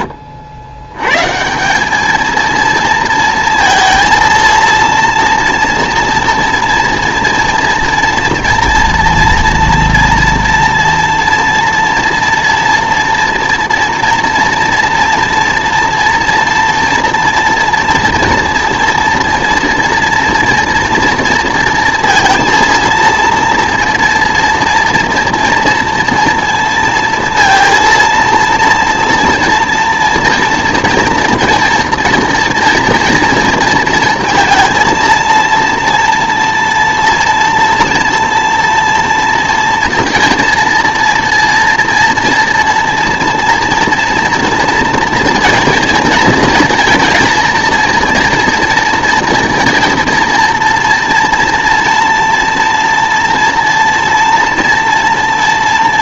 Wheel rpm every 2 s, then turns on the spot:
90, 230, 230, 230, 230, 230, 240, 230, 230, 230, 230, 230, 230, 230, 230, 230, 240, 230, 230, 240, 230, 230, 230, 230, 230, 230, 230, 240.
none